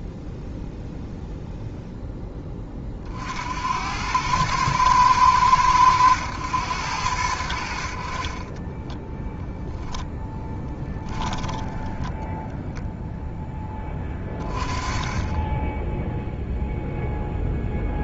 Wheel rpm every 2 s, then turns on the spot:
0, 40, 110, 90, 20, 10, 0, 30, 0.
8-12